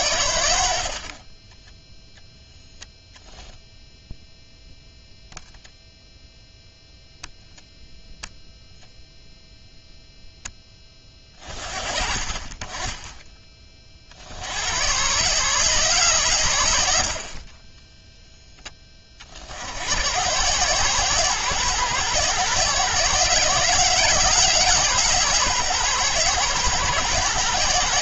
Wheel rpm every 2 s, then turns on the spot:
40, 0, 0, 0, 0, 20, 20, 110, 60, 20, 120, 130, 130, 120.
0-2